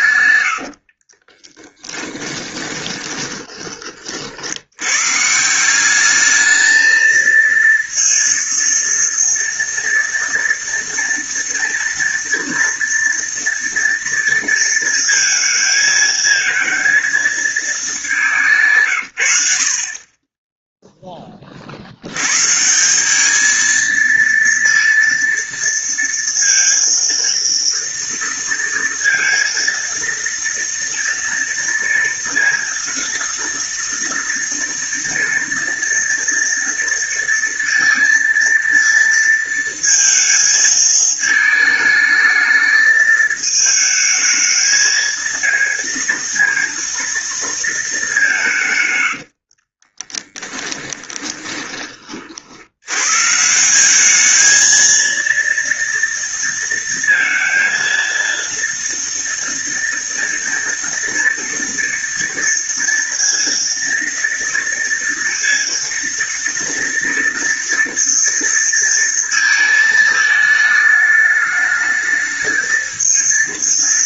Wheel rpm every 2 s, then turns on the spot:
50, 20, 110, 220, 230, 230, 230, 230, 220, 130, 10, 190, 230, 230, 230, 230, 230, 230, 230, 230, 220, 220, 230, 230, 120, 20, 120, 230, 230, 230, 230, 230, 230, 230, 230, 210, 220.
0-4 48-52